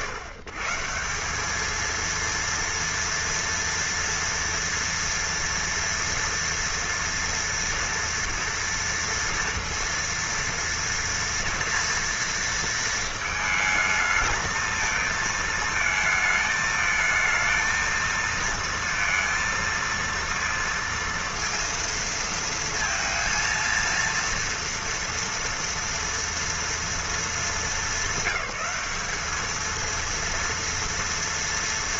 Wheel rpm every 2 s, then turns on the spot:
140, 230, 230, 230, 230, 230, 230, 220, 220, 230, 230, 230, 230, 230, 200, 230.
none